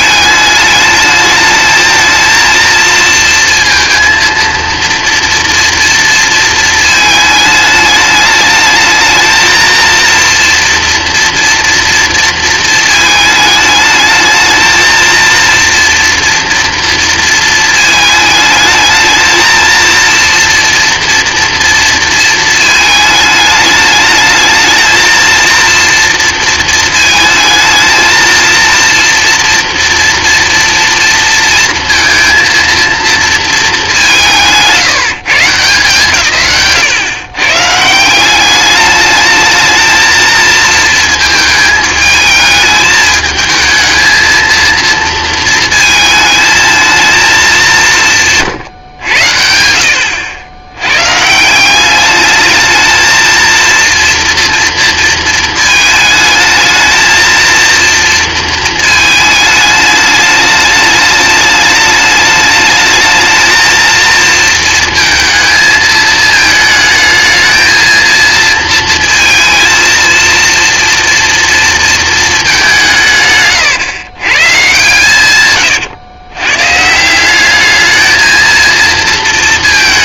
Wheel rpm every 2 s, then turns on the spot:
210, 230, 230, 230, 220, 240, 220, 220, 230, 220, 230, 220, 220, 230, 230, 230, 230, 170, 140, 210, 220, 220, 230, 220, 120, 90, 220, 230, 220, 220, 210, 210, 230, 220, 230, 230, 190, 130, 130, 230.
none